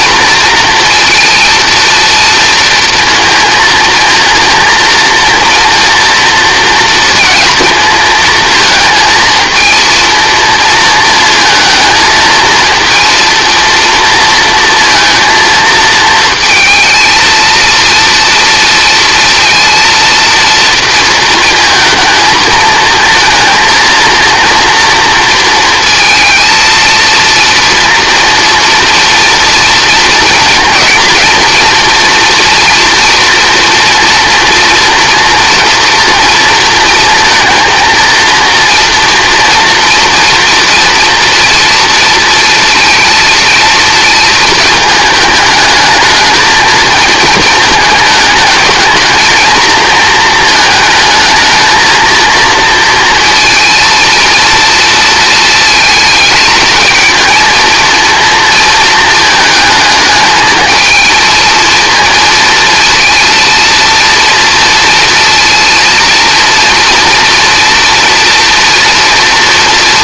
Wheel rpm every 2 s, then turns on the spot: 230, 230, 230, 230, 220, 230, 220, 230, 230, 230, 230, 220, 230, 230, 230, 230, 230, 230, 230, 230, 230, 230, 220, 220, 220, 220, 230, 230, 220, 220, 220, 230, 230, 230, 230.
none